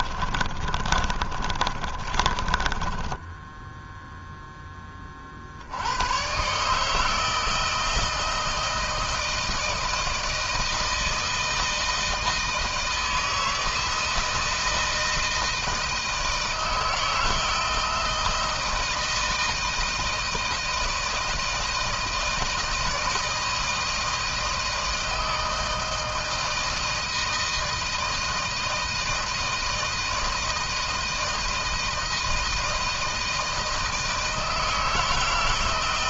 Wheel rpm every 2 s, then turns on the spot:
30, 20, 20, 150, 160, 160, 160, 160, 160, 160, 160, 160, 160, 160, 160, 160, 160, 160.
0-4